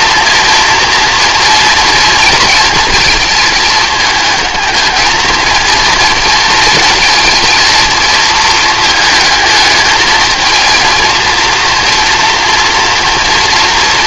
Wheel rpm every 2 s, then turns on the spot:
230, 230, 220, 230, 220, 230, 230.
none